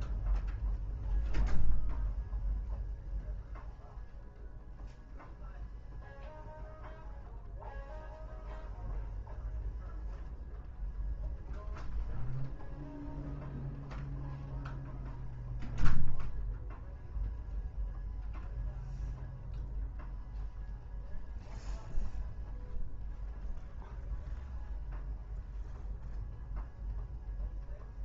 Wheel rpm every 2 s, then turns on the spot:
0, 0, 0, 0, 0, 0, 0, 0, 0, 0, 0, 0, 0, 0.
none